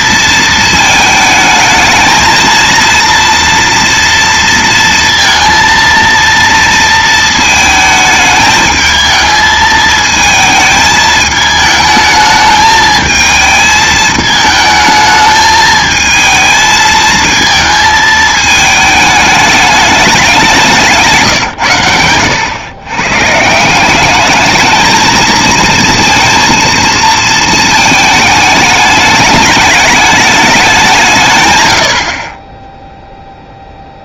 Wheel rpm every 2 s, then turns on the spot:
220, 230, 230, 230, 220, 220, 220, 220, 220, 220, 180, 120, 220, 230, 210, 190, 0.
none